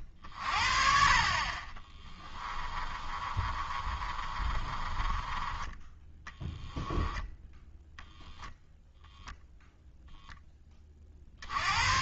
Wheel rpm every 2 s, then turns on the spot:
40, 20, 20, 10, 0, 20.
2-8